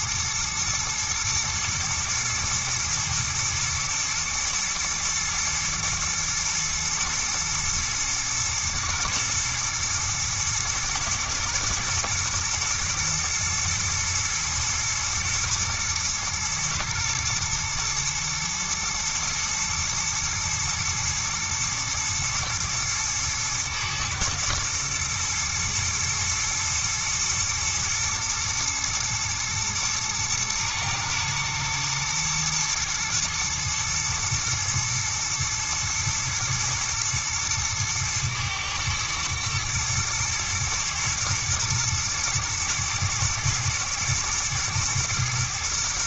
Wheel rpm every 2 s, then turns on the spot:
120, 120, 110, 120, 120, 110, 110, 110, 120, 110, 110, 110, 110, 110, 120, 110, 120, 110, 110, 110, 110, 110, 120.
none